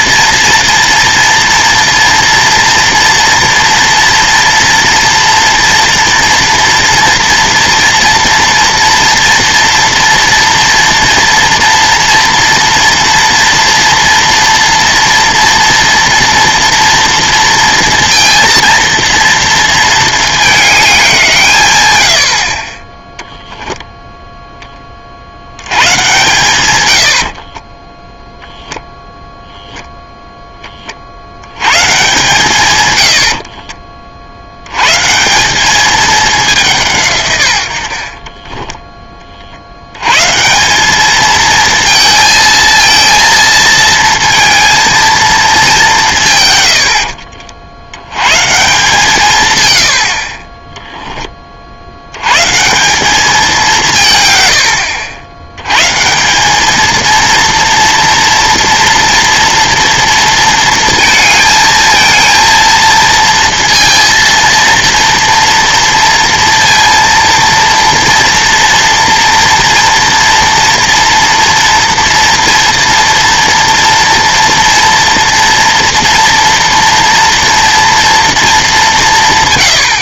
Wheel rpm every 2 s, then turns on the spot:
230, 230, 230, 230, 230, 230, 240, 230, 230, 230, 210, 50, 10, 110, 0, 20, 130, 80, 190, 20, 160, 230, 230, 120, 140, 20, 150, 110, 200, 230, 230, 230, 230, 230, 230, 230, 230, 230, 230, 220.
38-40 50-52